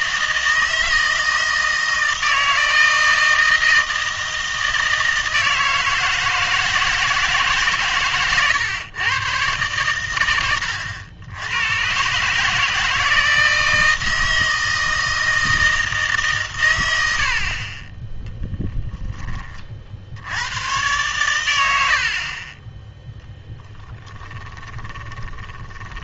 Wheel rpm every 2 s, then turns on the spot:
160, 160, 160, 160, 110, 80, 150, 160, 100, 10, 110, 10, 20.
10-12 24-26